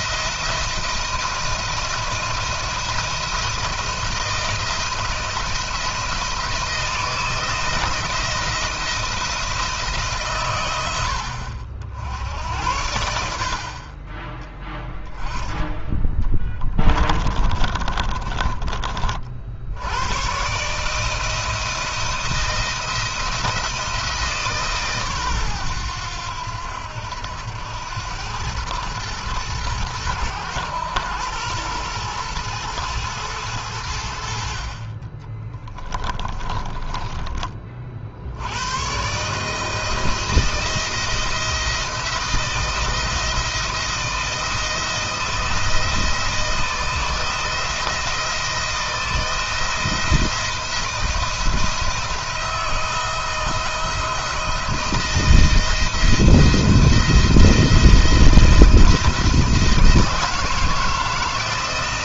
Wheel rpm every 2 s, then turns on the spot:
170, 160, 170, 160, 160, 110, 80, 10, 20, 30, 140, 170, 150, 90, 110, 110, 110, 50, 20, 110, 170, 170, 170, 170, 170, 170, 170, 160, 170, 170, 160.
16-18 36-38